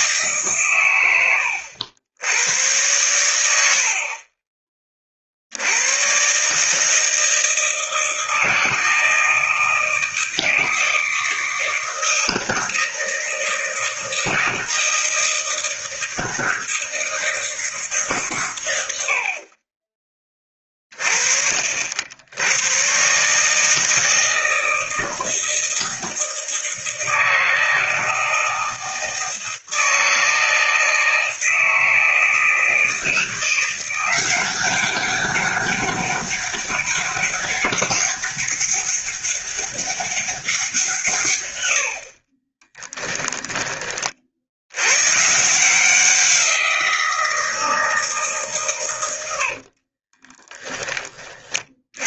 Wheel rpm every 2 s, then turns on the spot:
120, 110, 30, 150, 160, 160, 160, 160, 160, 100, 30, 120, 160, 160, 160, 160, 160, 190, 200, 200, 170, 10, 100, 170, 130, 10.
42-44